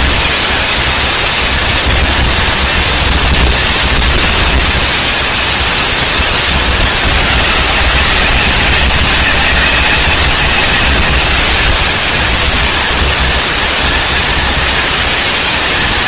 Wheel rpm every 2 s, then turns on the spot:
230, 230, 230, 230, 190, 200, 220, 220.
none